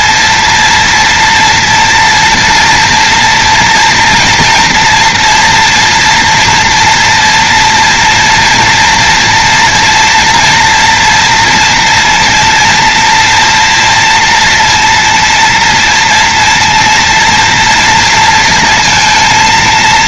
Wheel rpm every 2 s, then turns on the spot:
230, 230, 230, 230, 230, 230, 240, 230, 230, 230.
none